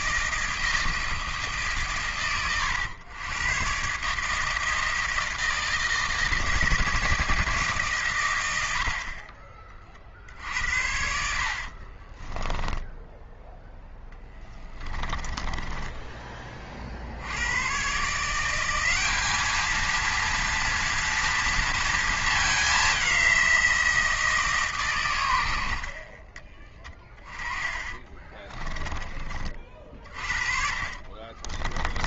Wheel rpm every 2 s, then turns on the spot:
160, 110, 160, 160, 80, 60, 10, 20, 30, 180, 230, 200, 150, 20, 10, 40.
12-16 28-32